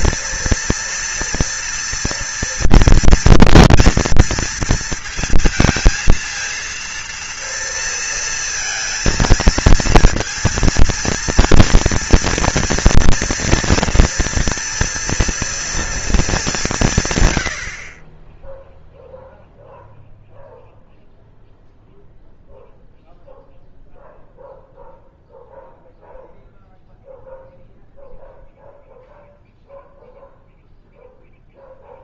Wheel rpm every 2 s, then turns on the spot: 230, 230, 230, 230, 230, 230, 240, 230, 190, 0, 0, 0, 0, 0, 0, 0.
none